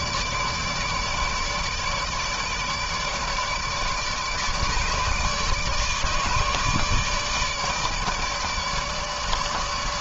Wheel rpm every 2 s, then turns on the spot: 150, 150, 150, 160, 160.
none